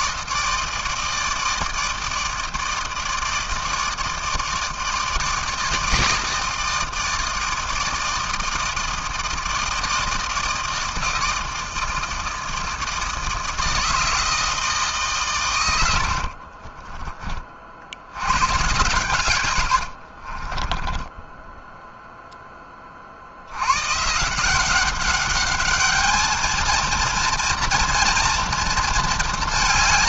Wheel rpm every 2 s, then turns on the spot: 160, 160, 160, 160, 160, 160, 160, 160, 40, 120, 20, 10, 190, 230, 230.
16-18 20-22